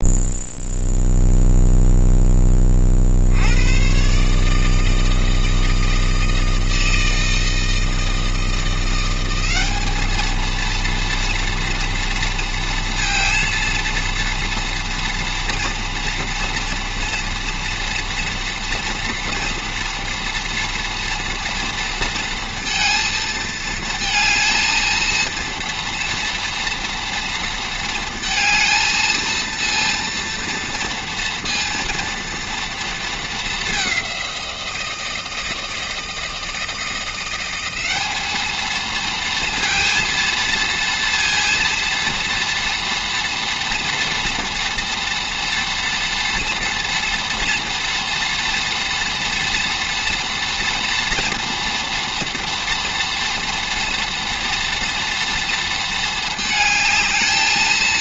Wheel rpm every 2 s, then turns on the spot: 0, 40, 160, 160, 170, 230, 230, 230, 230, 230, 240, 230, 230, 230, 230, 230, 230, 170, 170, 220, 230, 230, 230, 230, 230, 240, 230, 240, 220.
none